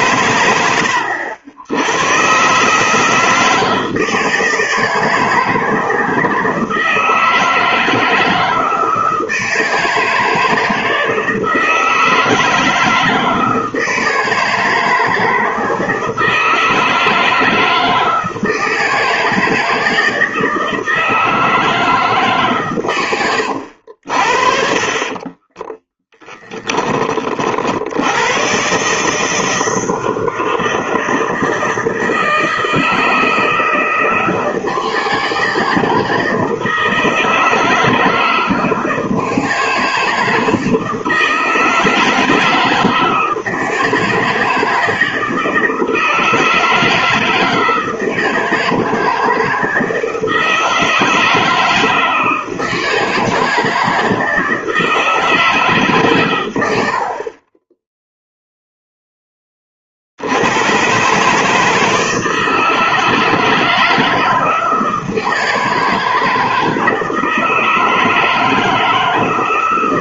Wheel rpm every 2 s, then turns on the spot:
100, 140, 160, 160, 160, 160, 160, 160, 160, 160, 160, 150, 50, 20, 110, 160, 160, 160, 160, 160, 160, 160, 160, 160, 160, 160, 160, 160, 100, 0, 90, 170, 160, 160, 160.
26-28